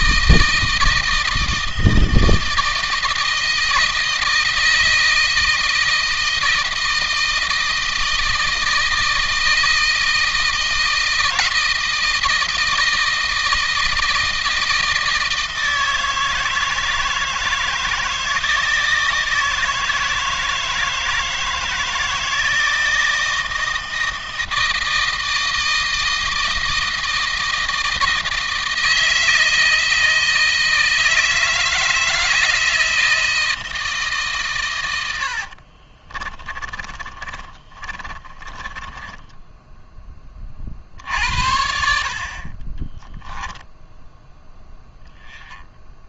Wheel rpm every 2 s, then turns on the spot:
160, 160, 160, 160, 160, 160, 160, 160, 160, 160, 160, 160, 160, 160, 160, 160, 160, 110, 20, 20, 40, 30, 0.
36-40 42-44